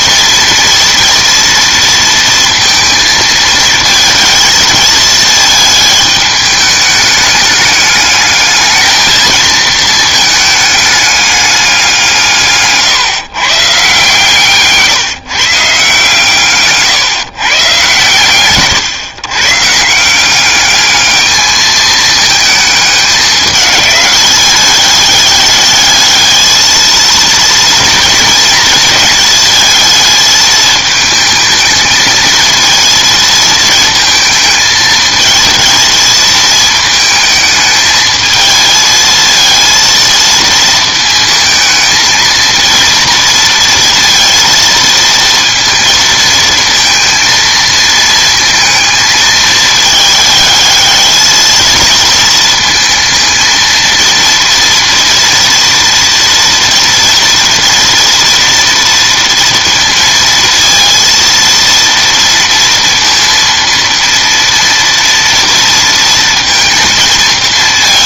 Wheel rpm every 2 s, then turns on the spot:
230, 230, 220, 210, 210, 210, 150, 140, 130, 140, 200, 210, 200, 220, 230, 220, 230, 220, 220, 220, 230, 230, 230, 230, 220, 220, 230, 230, 240, 230, 230, 230, 230, 230.
14-18